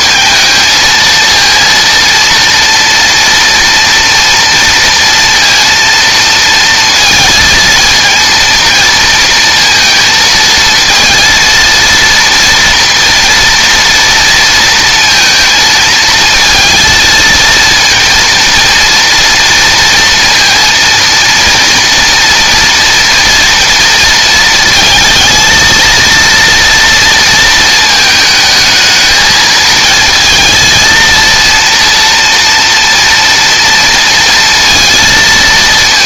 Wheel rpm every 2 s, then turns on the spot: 230, 230, 230, 230, 230, 230, 230, 230, 230, 230, 230, 230, 230, 230, 220, 230, 230, 230.
none